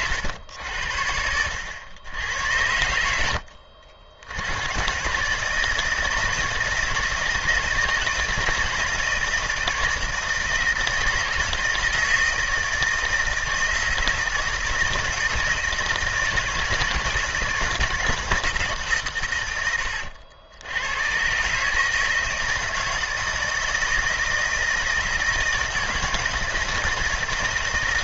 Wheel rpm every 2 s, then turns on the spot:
80, 80, 120, 160, 160, 160, 160, 160, 160, 140, 100, 160, 160, 160.
none